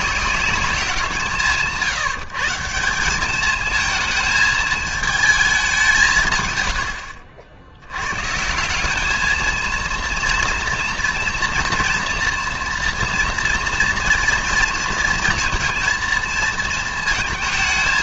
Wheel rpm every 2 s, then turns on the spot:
170, 170, 220, 120, 170, 230, 230, 230, 220.
none